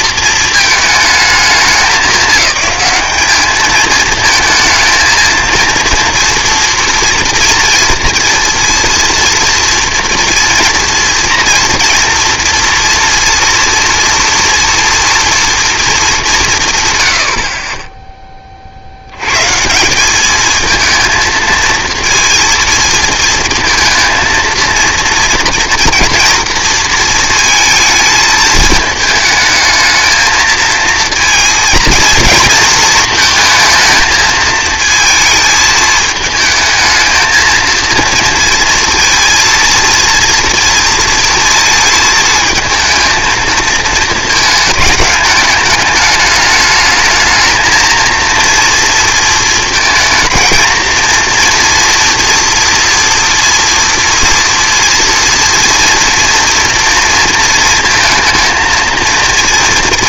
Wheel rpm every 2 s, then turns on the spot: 220, 210, 230, 230, 240, 240, 240, 240, 150, 50, 220, 230, 230, 230, 210, 230, 230, 220, 220, 230, 230, 220, 210, 210, 230, 220, 230, 230, 230, 230.
none